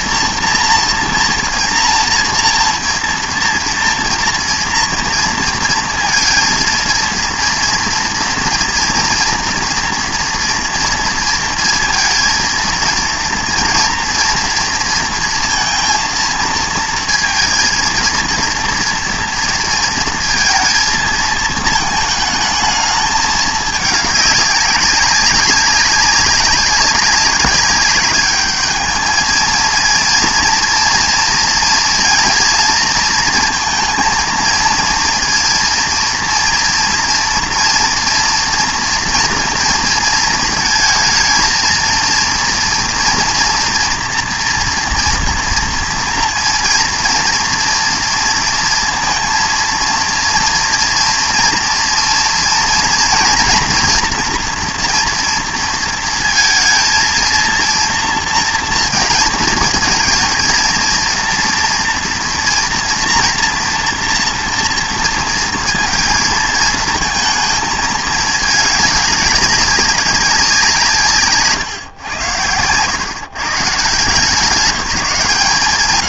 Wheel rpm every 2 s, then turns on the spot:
230, 230, 230, 230, 230, 230, 230, 230, 230, 230, 230, 220, 200, 200, 210, 240, 230, 230, 230, 230, 230, 230, 230, 230, 230, 230, 230, 240, 230, 230, 230, 240, 230, 230, 210, 170, 100, 180.
none